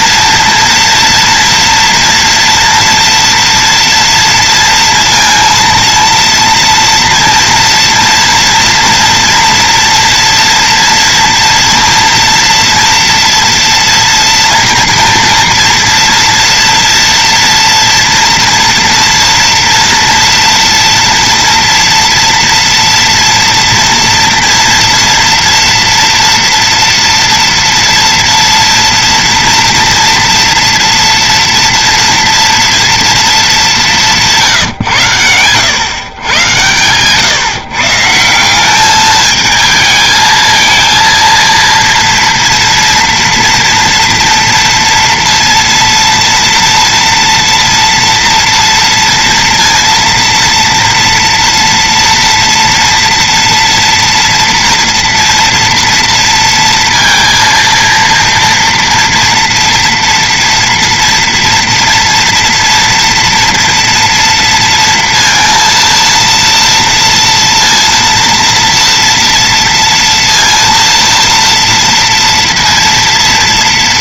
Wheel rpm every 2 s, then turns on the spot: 230, 230, 230, 230, 230, 230, 230, 230, 230, 230, 230, 230, 240, 230, 230, 230, 230, 160, 120, 170, 220, 230, 230, 230, 230, 230, 230, 230, 230, 230, 230, 230, 230, 230, 230, 230, 230.
none